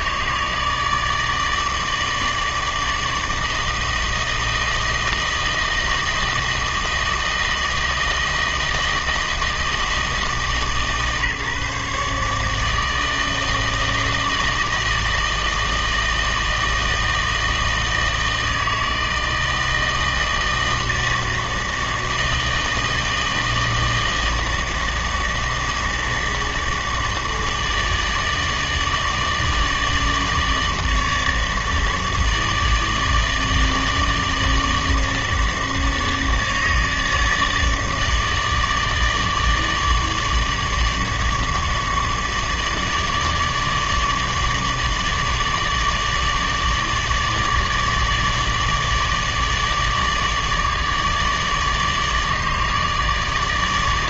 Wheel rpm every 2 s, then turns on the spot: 150, 160, 160, 160, 160, 150, 160, 160, 160, 160, 160, 160, 160, 150, 150, 150, 150, 160, 150, 160, 150, 150, 150, 150, 150, 150, 150.
none